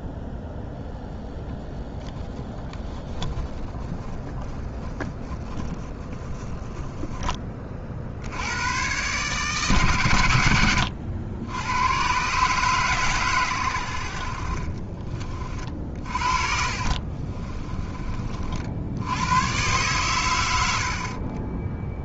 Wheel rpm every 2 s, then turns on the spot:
0, 10, 40, 10, 100, 100, 130, 40, 40, 70, 90.
14-18